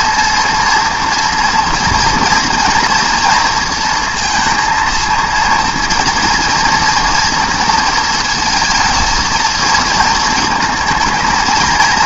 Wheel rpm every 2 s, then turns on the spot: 230, 230, 230, 230, 230, 220.
none